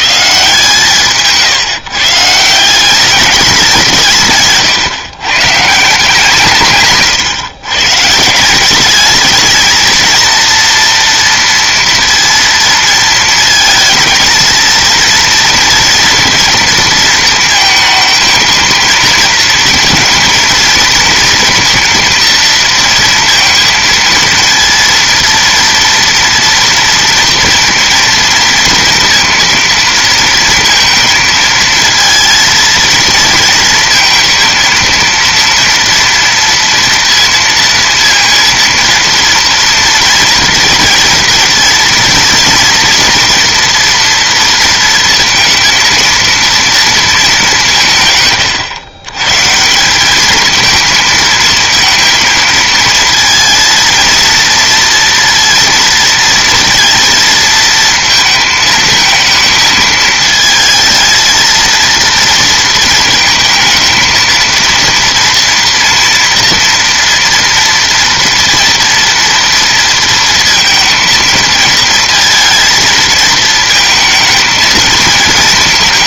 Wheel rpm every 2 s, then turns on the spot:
150, 170, 140, 150, 190, 230, 230, 220, 230, 230, 230, 230, 230, 230, 230, 230, 230, 230, 230, 230, 230, 230, 230, 230, 110, 220, 230, 230, 230, 220, 220, 230, 230, 230, 230, 230, 230, 220.
none